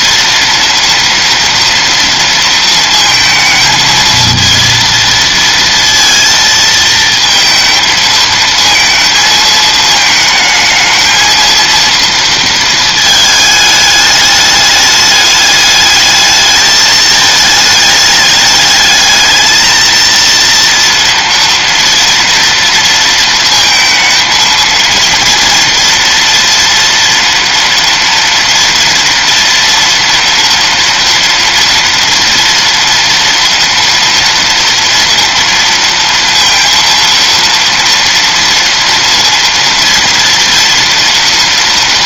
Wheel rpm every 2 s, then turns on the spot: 230, 230, 230, 230, 220, 220, 220, 210, 220, 210, 230, 230, 230, 230, 230, 230, 230, 230, 230, 230, 230.
none